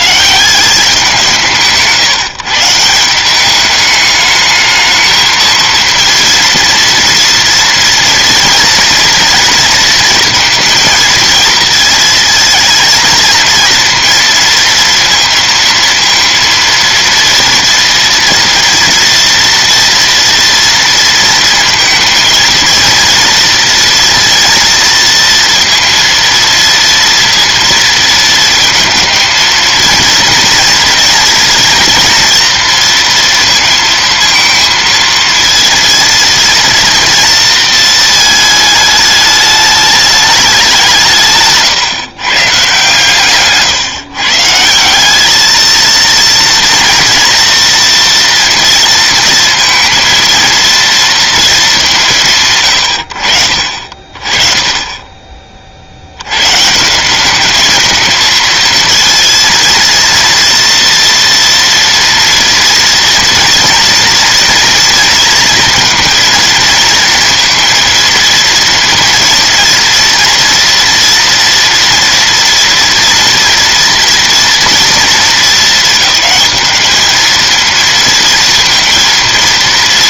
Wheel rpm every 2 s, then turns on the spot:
190, 160, 220, 230, 230, 230, 230, 230, 230, 230, 230, 230, 230, 230, 230, 230, 230, 230, 230, 220, 180, 150, 170, 230, 230, 230, 90, 30, 150, 230, 230, 230, 230, 230, 230, 230, 230, 230, 220, 230.
none